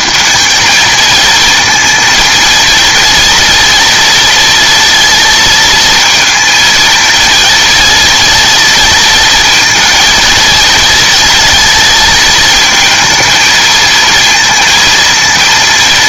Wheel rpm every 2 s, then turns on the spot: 220, 230, 230, 230, 230, 230, 220, 230.
none